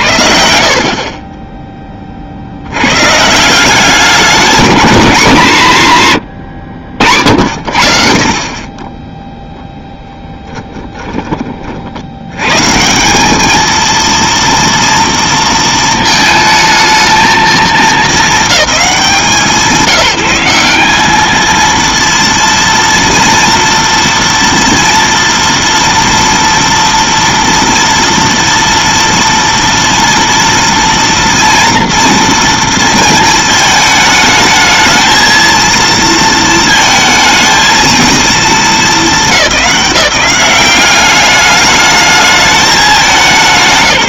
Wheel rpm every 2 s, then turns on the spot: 50, 110, 220, 70, 20, 10, 150, 230, 220, 190, 190, 230, 230, 230, 230, 230, 230, 220, 220, 210, 200, 210.
10-12